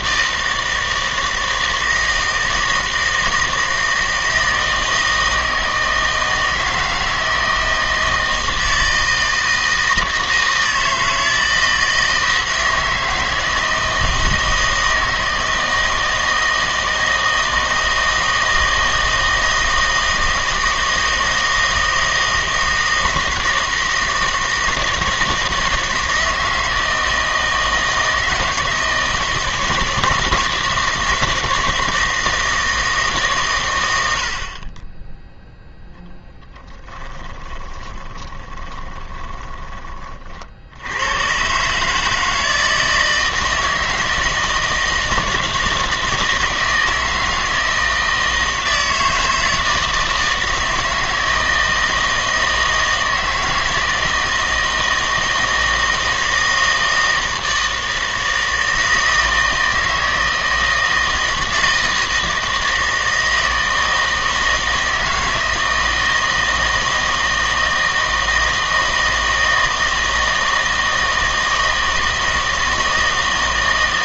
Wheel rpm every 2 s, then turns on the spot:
160, 160, 160, 160, 160, 160, 160, 160, 160, 160, 160, 160, 160, 160, 160, 160, 160, 30, 20, 20, 70, 160, 160, 160, 160, 160, 160, 160, 160, 160, 160, 160, 160, 160, 160, 160, 160.
36-40